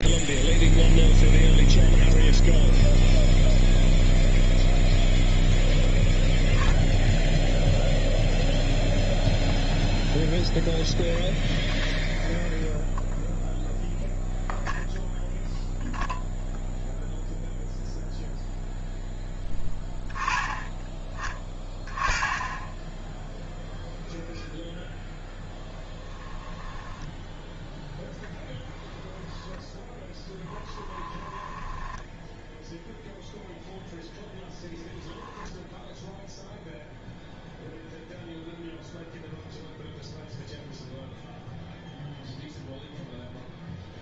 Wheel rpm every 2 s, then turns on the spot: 0, 0, 0, 0, 0, 0, 0, 0, 0, 0, 10, 10, 0, 10, 10, 10, 0, 10, 0, 0, 0, 0.
30-32